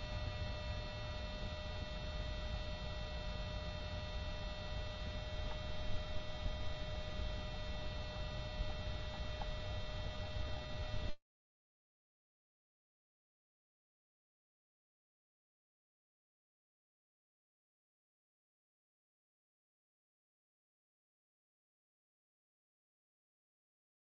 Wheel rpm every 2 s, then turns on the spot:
0, 0, 0, 0, 0, 0, 0, 0, 0, 0, 0, 0.
none